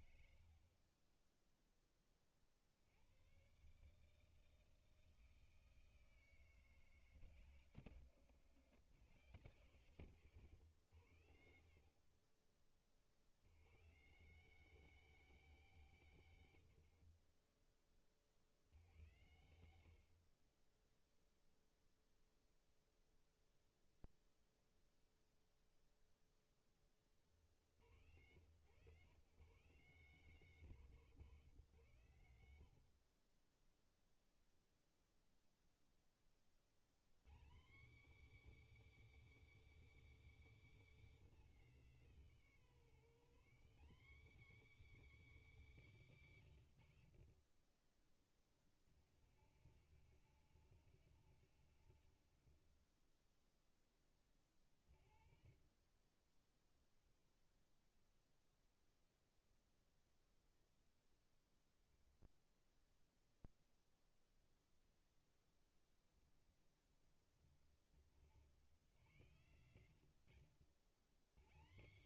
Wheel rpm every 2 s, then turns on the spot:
20, 90, 160, 140, 130, 120, 80, 220, 80, 110, 10, 0, 0, 50, 160, 180, 40, 0, 150, 330, 250, 140, 230, 90, 80, 120, 20, 30, 0, 0, 0, 0, 20, 40, 120, 120.
0-2 54-56